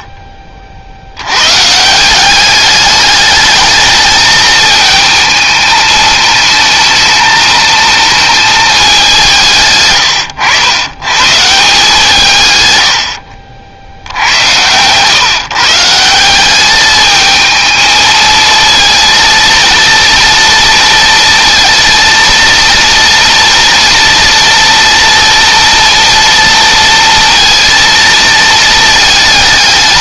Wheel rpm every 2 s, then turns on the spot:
40, 200, 220, 220, 220, 100, 120, 110, 200, 220, 230, 230, 230, 230, 220.
none